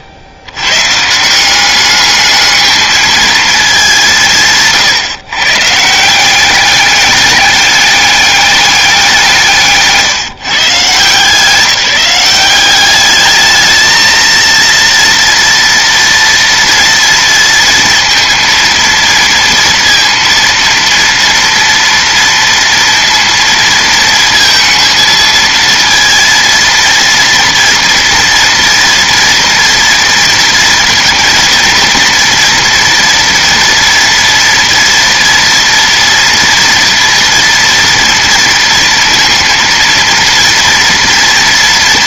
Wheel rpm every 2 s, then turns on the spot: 90, 220, 150, 190, 200, 160, 200, 230, 230, 230, 230, 230, 230, 230, 230, 230, 240, 230, 230, 230, 230.
4-6